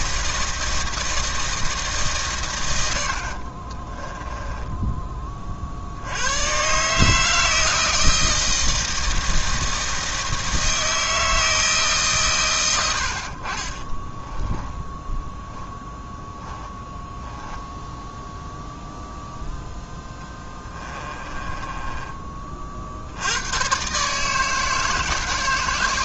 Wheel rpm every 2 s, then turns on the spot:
160, 100, 10, 140, 160, 160, 100, 10, 10, 0, 20, 50, 150.
4-6 14-18 20-22